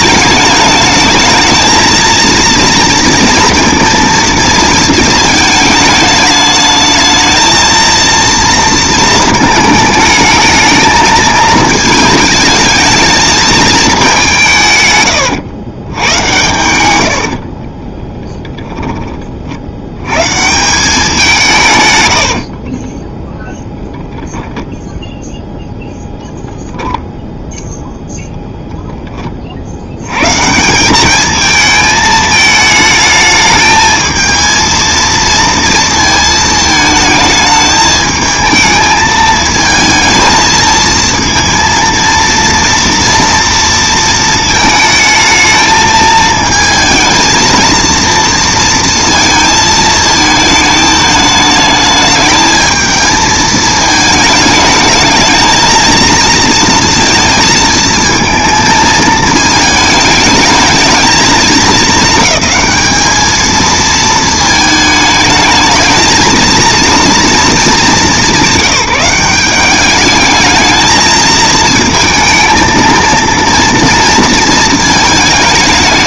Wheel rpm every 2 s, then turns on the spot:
210, 230, 220, 220, 230, 220, 220, 150, 90, 10, 170, 40, 0, 0, 0, 170, 220, 230, 220, 220, 220, 230, 220, 220, 230, 220, 220, 220, 230, 230, 220, 220, 220, 230, 200, 220, 230, 220.
16-18 22-24